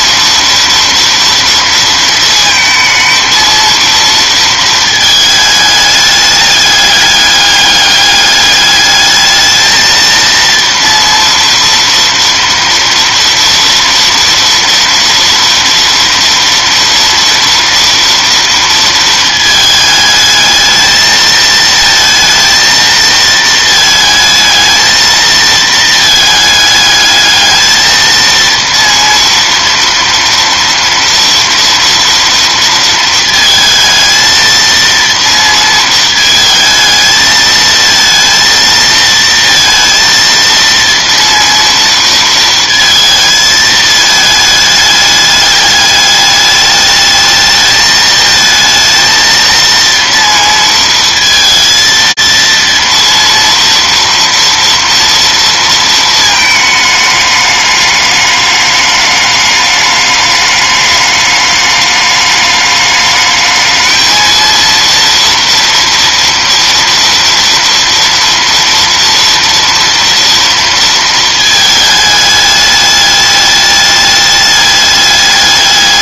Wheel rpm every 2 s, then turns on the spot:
230, 220, 220, 210, 210, 230, 230, 230, 230, 230, 220, 230, 220, 210, 230, 230, 230, 230, 220, 230, 230, 230, 210, 210, 220, 230, 230, 230, 220, 210, 210, 210, 230, 230, 230, 230, 210, 210.
none